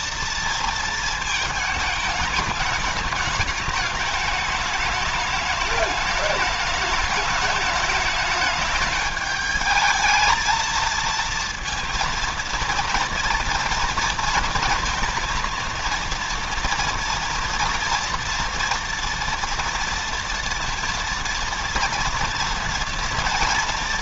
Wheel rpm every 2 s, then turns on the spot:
230, 210, 210, 210, 210, 220, 230, 230, 230, 230, 230, 230.
none